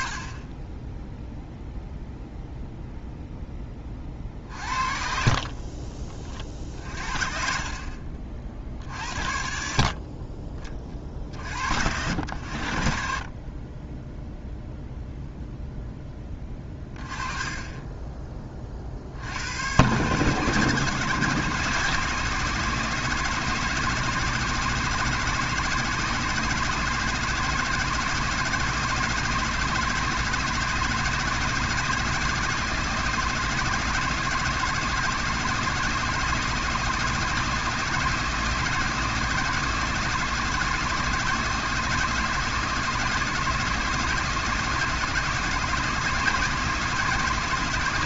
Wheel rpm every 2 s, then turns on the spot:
20, 0, 50, 40, 50, 30, 70, 0, 20, 30, 150, 160, 160, 160, 160, 160, 170, 160, 160, 160, 160, 160, 160, 160.
4-8